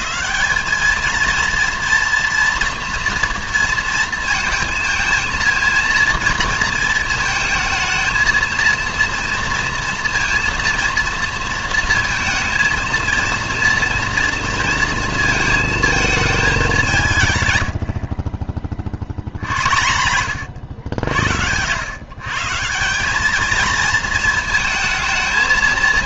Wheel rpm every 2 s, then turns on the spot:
200, 240, 230, 230, 230, 240, 230, 230, 200, 40, 90, 150, 230.
none